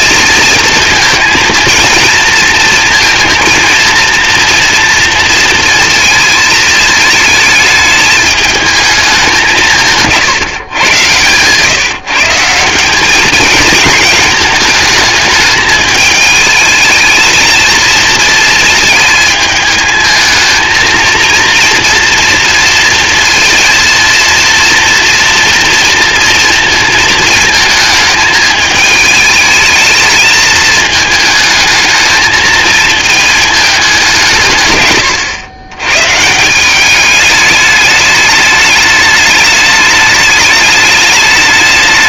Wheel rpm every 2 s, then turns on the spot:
230, 230, 230, 220, 200, 120, 200, 220, 220, 220, 230, 230, 230, 230, 220, 220, 220, 110, 200, 210, 210.
none